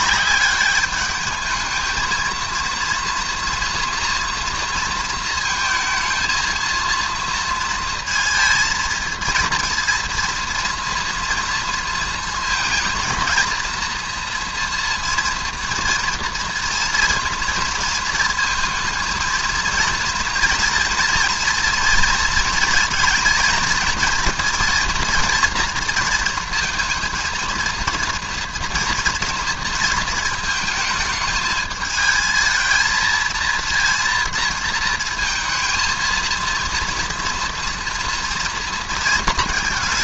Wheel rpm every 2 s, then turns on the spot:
200, 230, 230, 230, 220, 240, 230, 230, 230, 230, 230, 230, 230, 230, 230, 220, 220, 230, 230, 230.
none